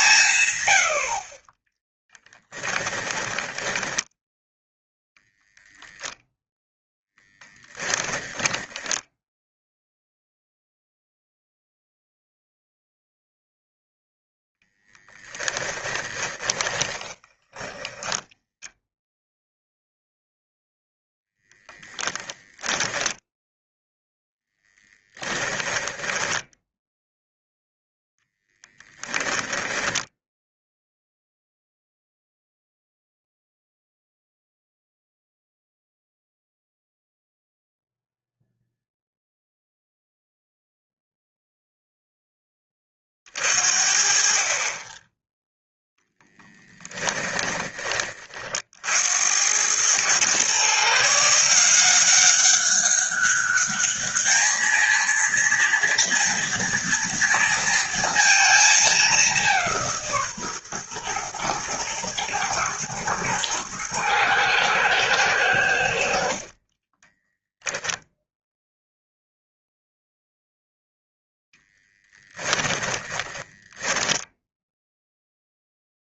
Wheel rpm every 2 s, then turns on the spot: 100, 10, 0, 0, 10, 0, 0, 10, 10, 0, 0, 10, 10, 0, 10, 0, 0, 0, 0, 0, 0, 30, 20, 10, 60, 140, 190, 230, 230, 210, 130, 110, 110, 30, 0, 0, 10, 0.
0-4 14-18 22-26 46-48 66-68 72-74